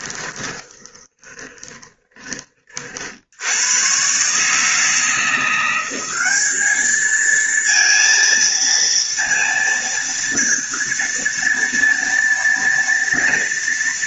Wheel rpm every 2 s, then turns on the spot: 20, 30, 140, 200, 230, 230, 230.
0-2